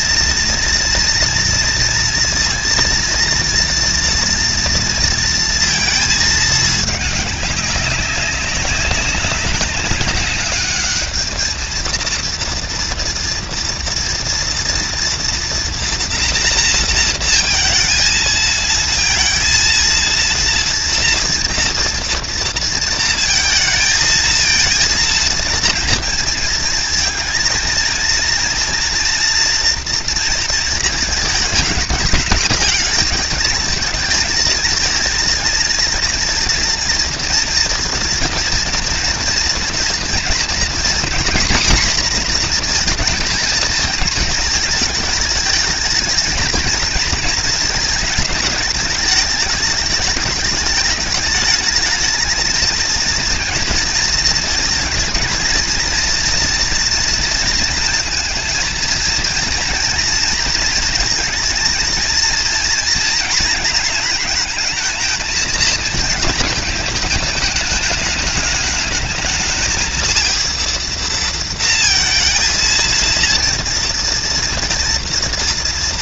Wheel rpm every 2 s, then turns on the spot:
230, 230, 230, 220, 200, 200, 230, 230, 230, 220, 230, 230, 220, 230, 230, 230, 210, 220, 230, 240, 230, 240, 220, 220, 210, 210, 230, 230, 230, 230, 230, 230, 220, 220, 210, 220, 230, 240.
none